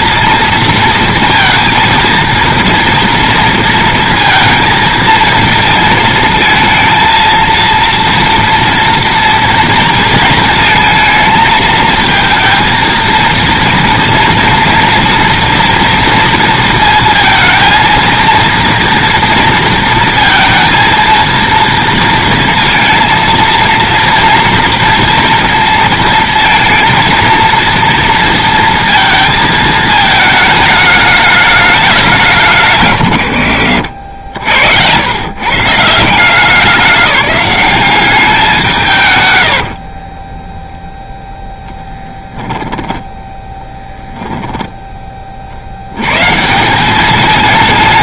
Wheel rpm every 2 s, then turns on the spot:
230, 230, 230, 220, 230, 230, 230, 230, 230, 230, 230, 230, 230, 230, 230, 210, 160, 80, 190, 180, 10, 10, 10, 160.
40-44